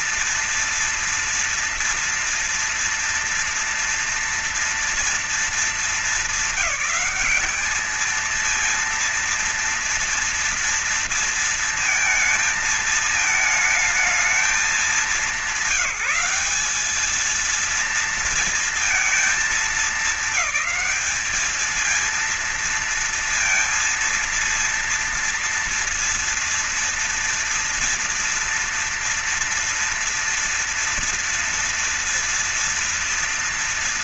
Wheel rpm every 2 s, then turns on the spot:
230, 230, 230, 210, 230, 230, 220, 220, 210, 230, 220, 230, 230, 230, 240, 240, 230.
none